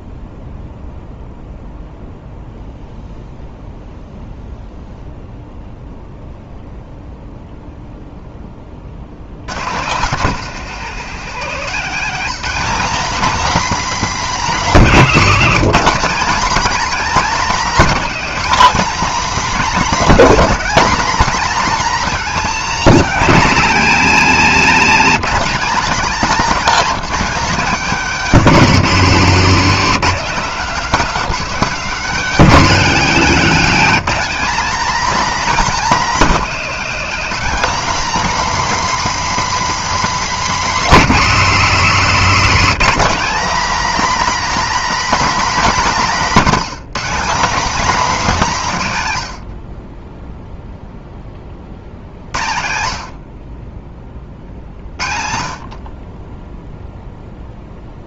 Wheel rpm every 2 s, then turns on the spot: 0, 0, 0, 0, 10, 170, 240, 260, 240, 250, 240, 220, 230, 230, 210, 220, 230, 230, 220, 270, 260, 230, 280, 220, 180, 0, 70, 50, 0.
30-32